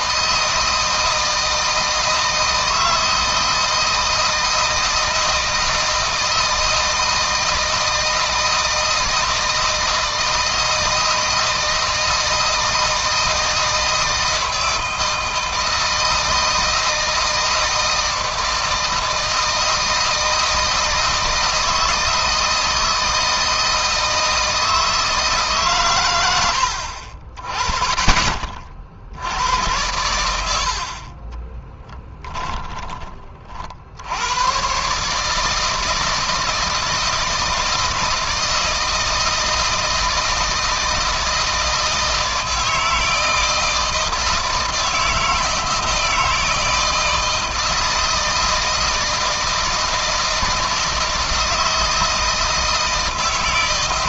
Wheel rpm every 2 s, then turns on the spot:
160, 160, 160, 160, 160, 160, 160, 160, 160, 160, 160, 160, 160, 70, 60, 60, 20, 130, 160, 160, 160, 160, 160, 160, 160, 160, 160.
30-32